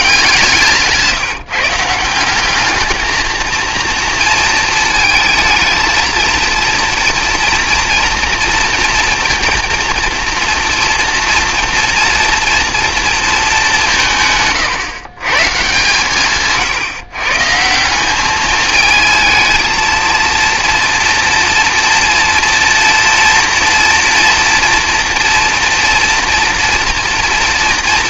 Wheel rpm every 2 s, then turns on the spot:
160, 210, 220, 230, 230, 230, 230, 140, 140, 220, 230, 230, 230, 230.
none